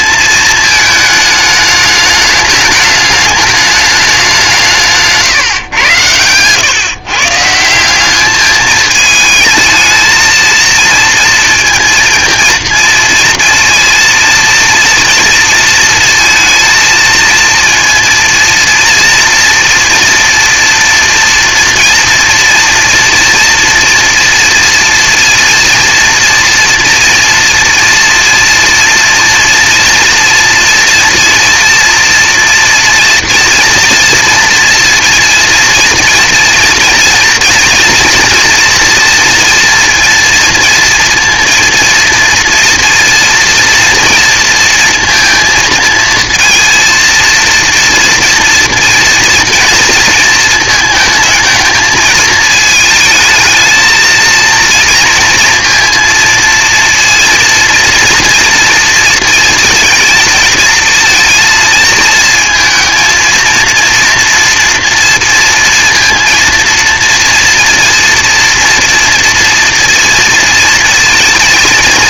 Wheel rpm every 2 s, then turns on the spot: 220, 210, 170, 120, 210, 230, 230, 230, 230, 230, 230, 240, 230, 230, 230, 230, 240, 230, 230, 230, 230, 230, 230, 230, 230, 220, 220, 230, 230, 230, 230, 230, 230, 230, 240, 230.
none